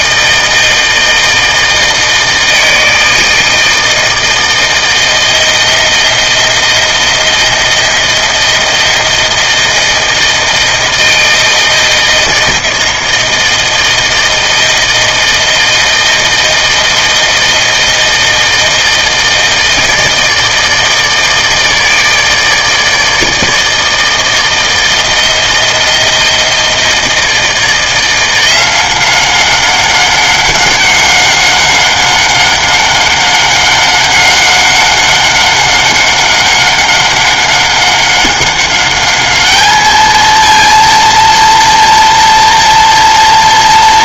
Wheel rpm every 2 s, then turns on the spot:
160, 160, 160, 160, 160, 160, 160, 160, 160, 160, 160, 160, 160, 160, 180, 190, 190, 190, 190, 200, 230, 230.
none